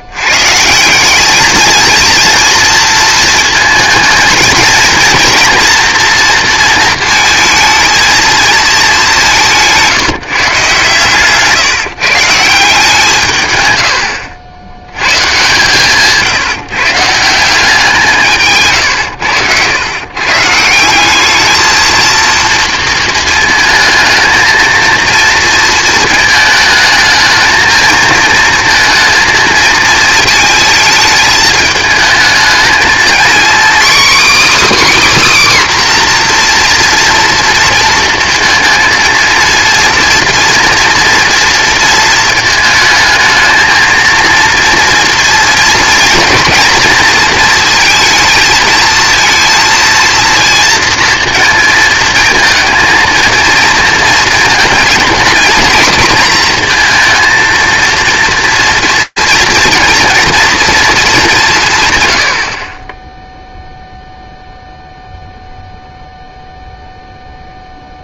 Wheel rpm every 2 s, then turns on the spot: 150, 230, 230, 230, 220, 140, 170, 80, 160, 140, 160, 230, 220, 220, 230, 220, 220, 300, 240, 230, 230, 220, 230, 240, 230, 230, 230, 230, 230, 230, 230, 60, 0, 0.
none